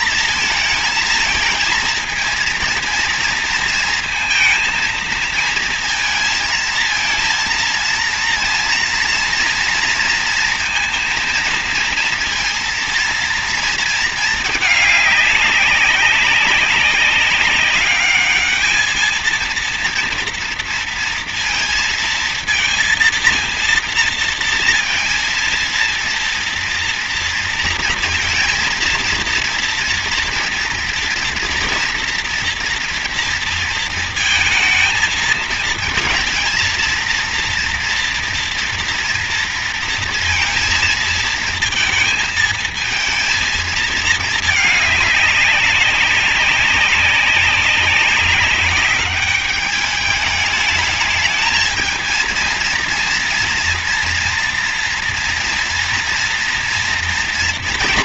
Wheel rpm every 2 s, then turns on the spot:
220, 230, 230, 230, 230, 230, 230, 220, 200, 210, 230, 230, 230, 230, 230, 230, 230, 220, 220, 230, 230, 220, 220, 190, 200, 210, 230, 230, 230.
none